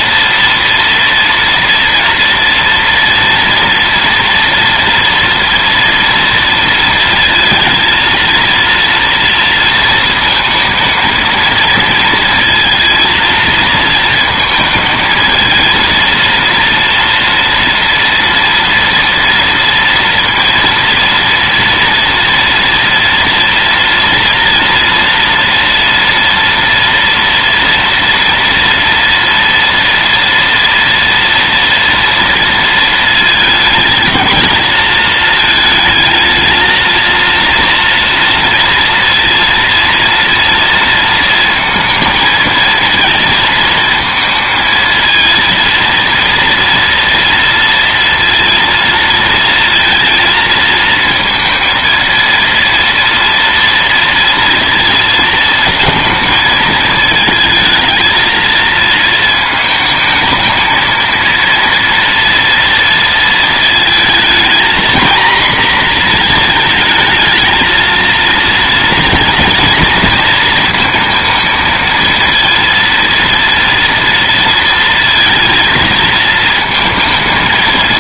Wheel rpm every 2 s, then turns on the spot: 230, 230, 230, 230, 230, 220, 230, 220, 230, 230, 230, 230, 230, 230, 230, 230, 230, 220, 220, 230, 230, 220, 230, 240, 230, 220, 230, 230, 220, 230, 220, 230, 230, 220, 230, 230, 230, 230, 220.
none